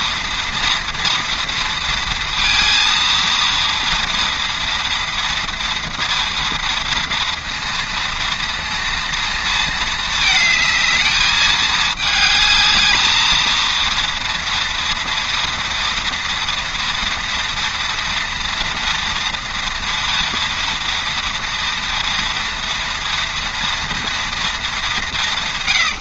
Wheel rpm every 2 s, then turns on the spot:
230, 230, 230, 230, 230, 220, 220, 230, 230, 230, 230, 230, 200.
none